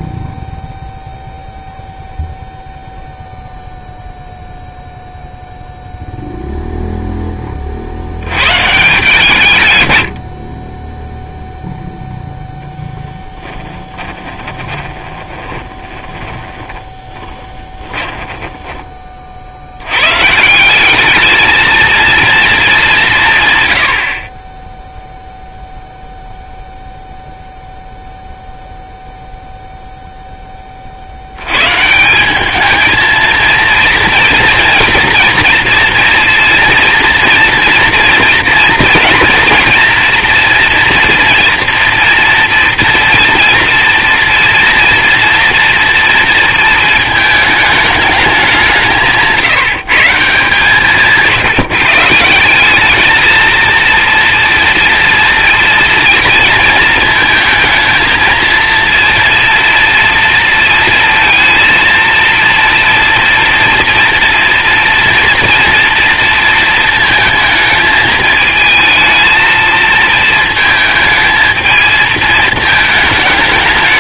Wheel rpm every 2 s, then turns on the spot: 0, 0, 0, 10, 150, 0, 10, 20, 20, 20, 190, 200, 0, 0, 0, 20, 210, 230, 230, 230, 240, 230, 230, 230, 180, 150, 180, 230, 230, 230, 230, 230, 230, 230, 220, 220, 220.
12-18